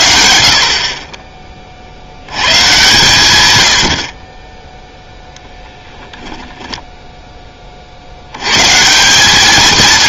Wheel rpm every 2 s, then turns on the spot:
50, 120, 0, 10, 150.
none